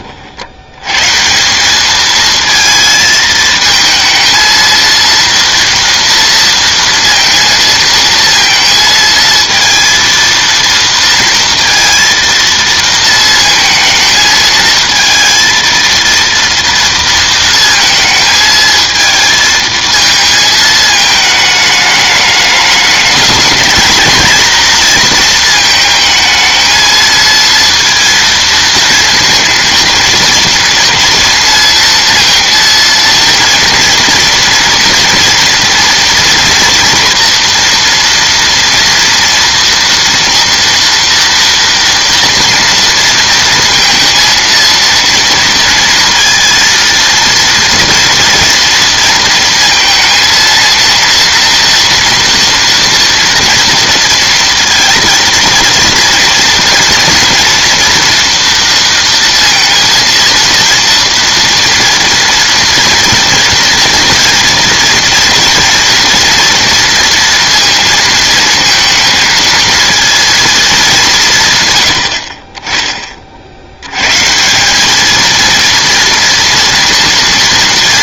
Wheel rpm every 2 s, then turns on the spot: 90, 220, 230, 230, 230, 230, 230, 220, 230, 220, 220, 210, 230, 220, 230, 230, 230, 230, 240, 230, 230, 240, 230, 230, 230, 230, 230, 230, 230, 230, 230, 230, 230, 230, 230, 210, 20, 180, 230.
none